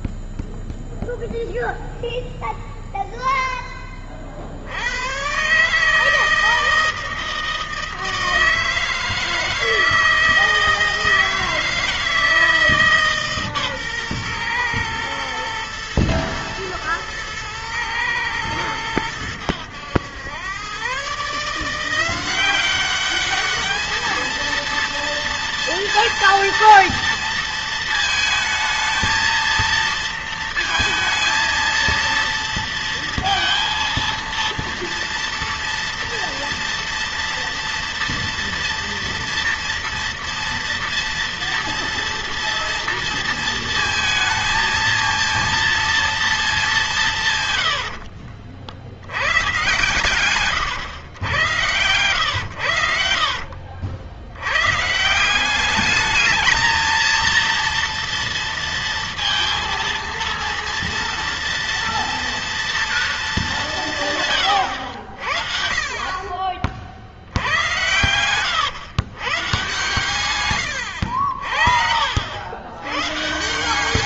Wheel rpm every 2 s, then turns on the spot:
0, 0, 50, 160, 160, 160, 160, 120, 110, 110, 120, 190, 230, 230, 220, 230, 230, 230, 230, 230, 230, 230, 230, 210, 60, 120, 100, 110, 220, 230, 230, 230, 110, 50, 110, 100, 100.
none